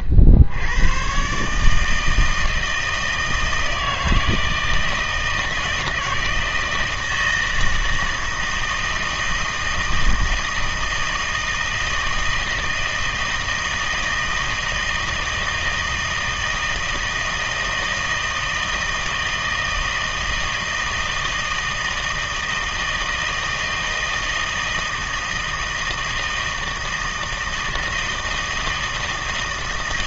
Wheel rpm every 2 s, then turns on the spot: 60, 160, 160, 160, 160, 160, 160, 160, 160, 160, 160, 160, 160, 160, 160.
none